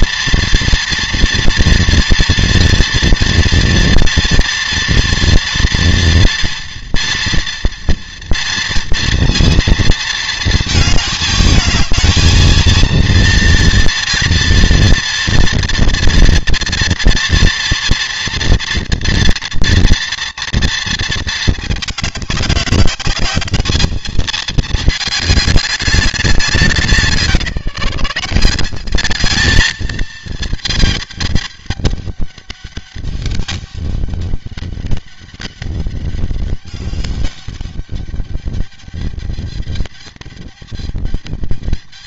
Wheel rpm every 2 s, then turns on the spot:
230, 230, 230, 230, 230, 220, 230, 230, 230, 240, 220, 200, 210, 170, 200, 220, 200, 200, 200, 210, 210.
none